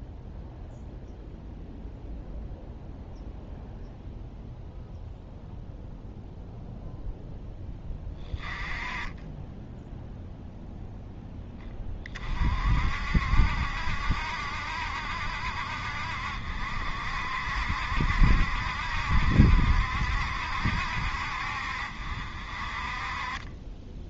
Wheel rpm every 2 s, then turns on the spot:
0, 0, 0, 0, 20, 0, 50, 70, 60, 70, 70, 40.
none